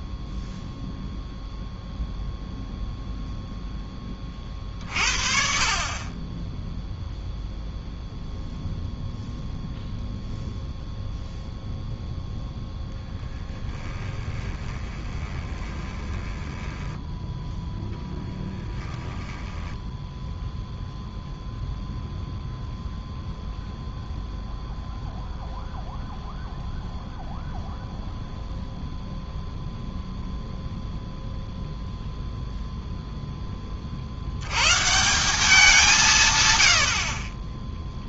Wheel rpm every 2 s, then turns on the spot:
0, 0, 40, 10, 0, 0, 0, 20, 10, 20, 0, 0, 0, 0, 0, 0, 0, 120, 90.
14-20